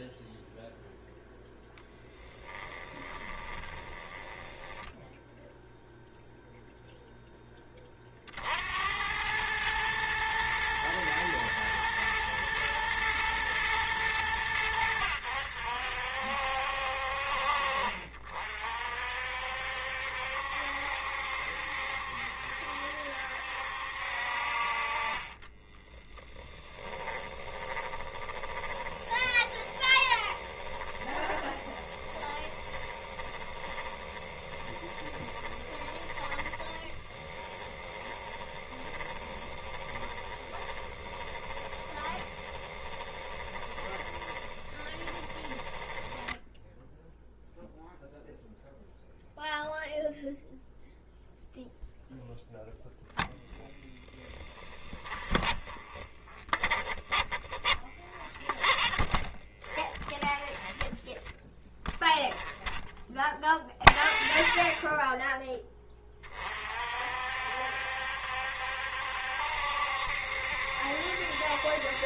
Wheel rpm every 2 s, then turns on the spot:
0, 20, 0, 0, 80, 120, 120, 90, 60, 60, 70, 70, 40, 30, 20, 20, 20, 20, 20, 30, 20, 20, 20, 0, 0, 0, 0, 20, 20, 30, 10, 0, 0, 50, 70, 70.
2-4 24-46 54-62